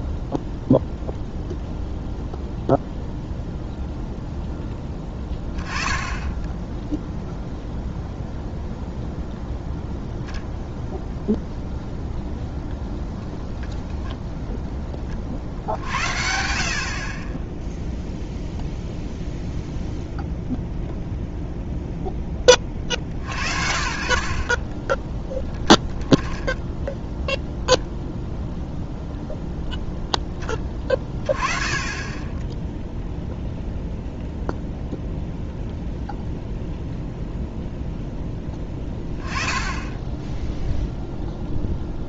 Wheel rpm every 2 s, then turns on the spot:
0, 0, 10, 10, 0, 0, 0, 20, 40, 0, 0, 40, 10, 0, 0, 20, 0, 0, 0, 20, 0.
none